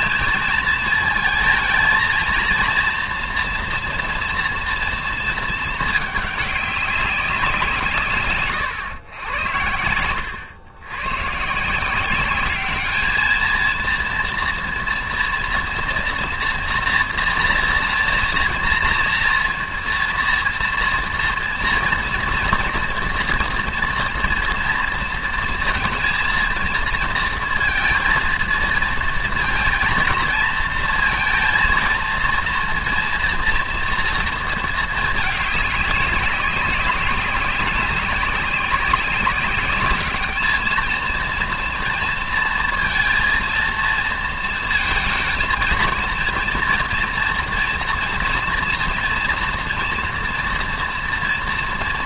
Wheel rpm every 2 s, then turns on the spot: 220, 230, 240, 200, 120, 100, 200, 230, 240, 230, 240, 240, 230, 230, 220, 230, 230, 230, 200, 190, 210, 230, 230, 230, 240, 240.
none